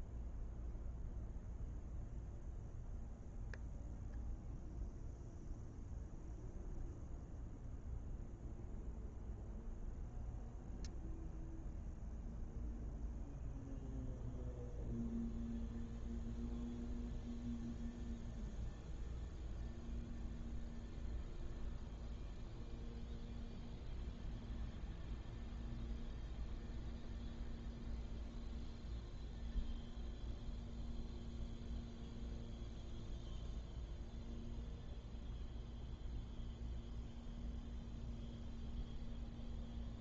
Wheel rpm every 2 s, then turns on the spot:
0, 0, 0, 0, 0, 0, 0, 0, 0, 0, 0, 0, 0, 0, 0, 0, 0, 0, 0, 0.
none